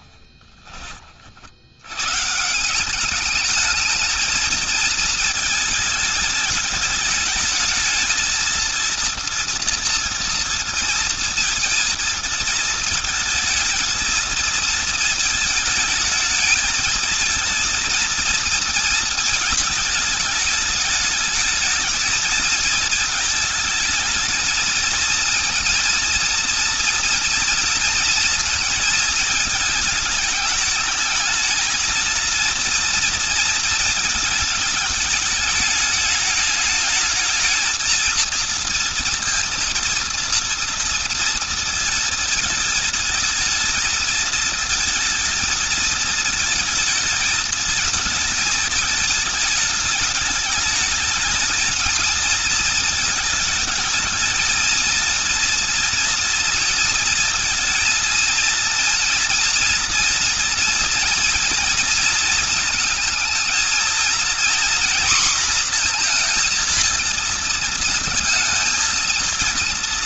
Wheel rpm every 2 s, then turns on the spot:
30, 190, 220, 220, 230, 230, 220, 220, 220, 220, 210, 220, 230, 240, 220, 220, 230, 220, 220, 230, 230, 220, 220, 220, 220, 210, 220, 230, 230, 230, 230, 220, 240, 230, 230.
none